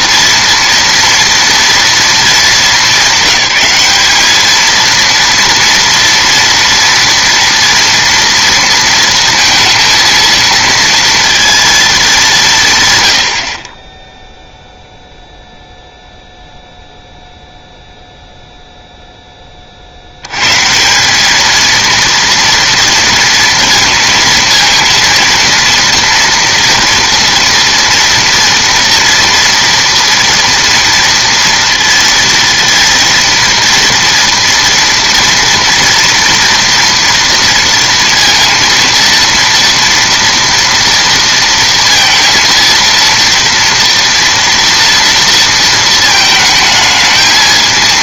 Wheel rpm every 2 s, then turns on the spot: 230, 200, 220, 230, 230, 230, 160, 0, 0, 0, 140, 230, 230, 230, 230, 230, 230, 230, 240, 230, 230, 230, 230, 220.
none